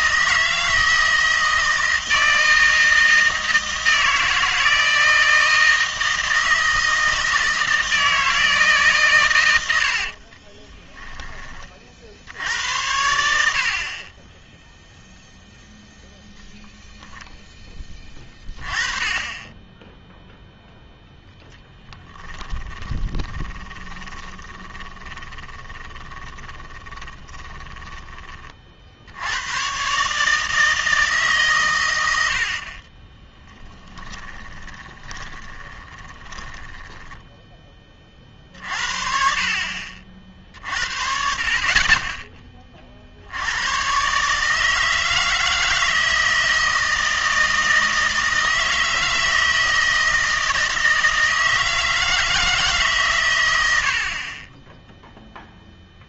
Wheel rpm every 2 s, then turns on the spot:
160, 160, 160, 160, 160, 20, 80, 0, 0, 20, 0, 10, 20, 20, 40, 160, 60, 20, 10, 50, 50, 20, 150, 160, 160, 160, 160, 20.
10-12 22-28 34-38